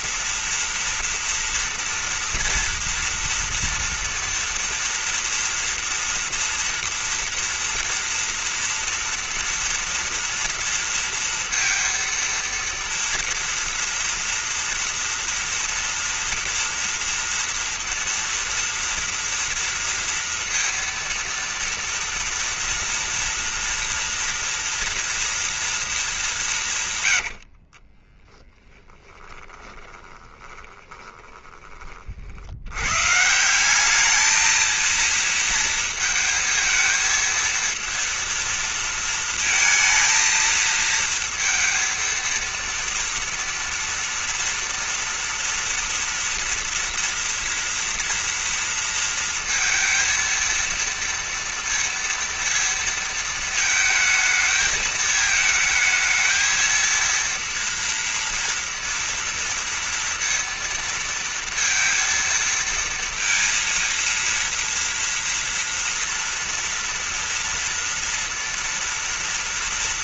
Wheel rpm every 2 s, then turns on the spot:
230, 230, 230, 230, 230, 230, 230, 230, 230, 230, 230, 230, 230, 200, 20, 20, 50, 210, 220, 230, 220, 230, 230, 230, 230, 230, 230, 220, 220, 230, 230, 230, 230, 230, 230.
28-32